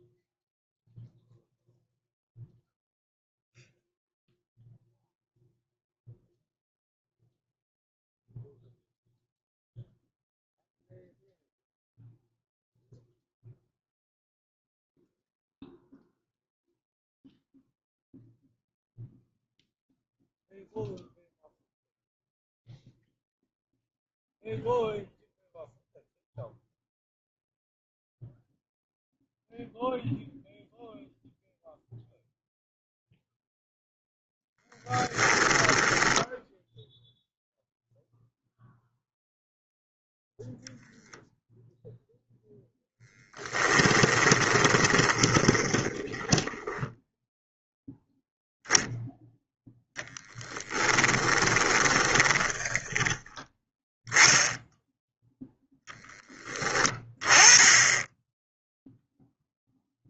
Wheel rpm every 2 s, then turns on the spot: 0, 0, 0, 0, 0, 0, 0, 0, 0, 0, 0, 0, 0, 0, 0, 0, 0, 10, 0, 0, 10, 10, 20, 10, 0, 10, 20, 0, 20, 0.
34-36 42-46 50-54